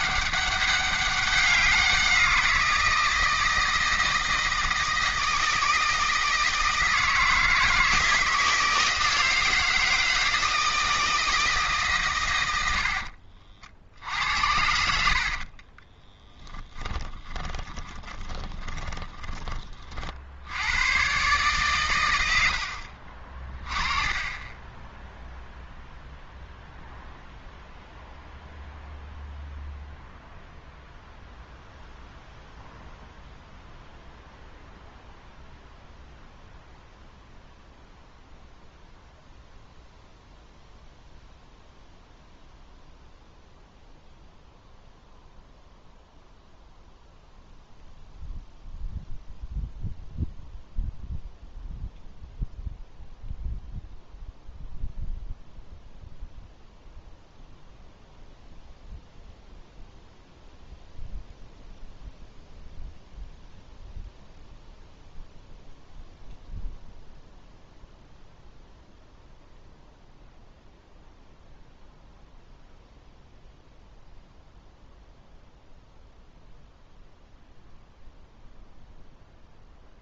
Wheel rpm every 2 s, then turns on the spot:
200, 170, 160, 160, 160, 160, 80, 70, 20, 20, 100, 70, 10, 0, 0, 0, 0, 0, 0, 0, 0, 0, 0, 0, 0, 0, 0, 0, 0, 0, 0, 0, 0, 0, 0, 0, 0, 0, 0, 0.
16-20 24-26